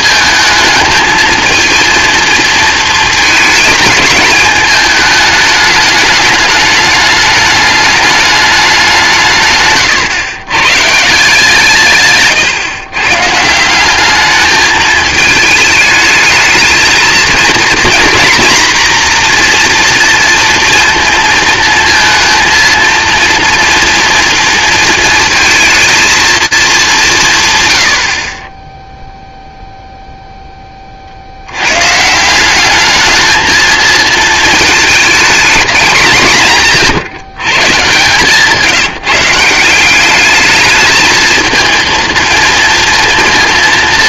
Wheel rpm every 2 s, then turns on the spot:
220, 220, 210, 210, 190, 150, 130, 220, 220, 240, 230, 230, 230, 200, 0, 10, 190, 220, 150, 160, 220, 230.
none